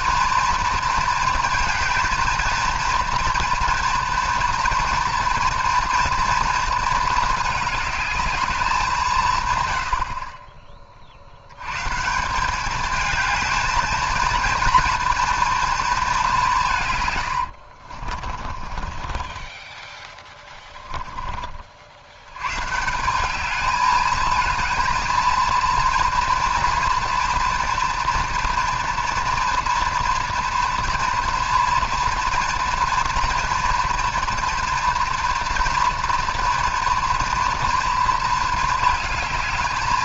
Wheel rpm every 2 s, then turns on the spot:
230, 230, 230, 230, 200, 30, 200, 240, 170, 40, 10, 130, 220, 230, 230, 230, 230, 230, 230, 220.
18-22